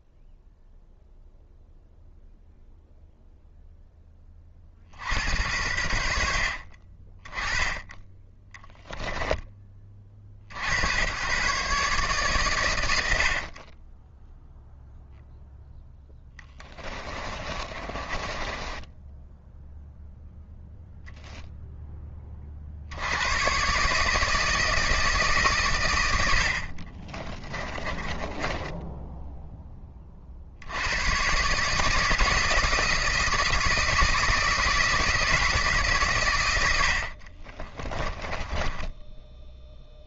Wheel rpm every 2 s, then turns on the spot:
0, 0, 60, 30, 10, 90, 80, 0, 30, 10, 0, 80, 160, 20, 10, 100, 160, 160, 80, 10.
16-20 26-28 38-40